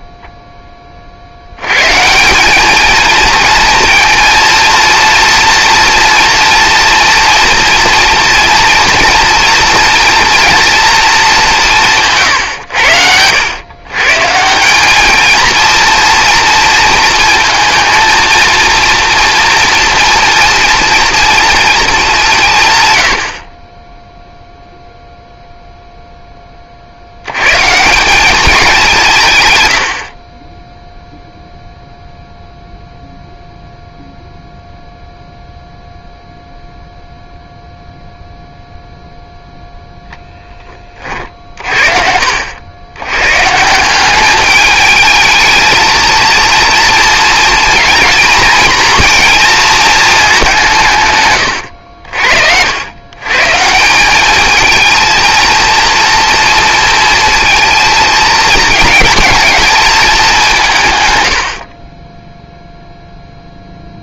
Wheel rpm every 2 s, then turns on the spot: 10, 190, 230, 230, 230, 230, 140, 160, 230, 230, 230, 160, 0, 30, 200, 30, 0, 0, 0, 0, 10, 80, 210, 230, 240, 190, 60, 210, 230, 220, 180, 0.
none